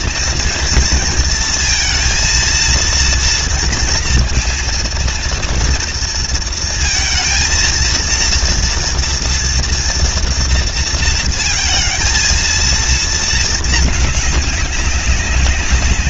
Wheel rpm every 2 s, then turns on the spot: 220, 230, 230, 230, 230, 230, 220, 200.
none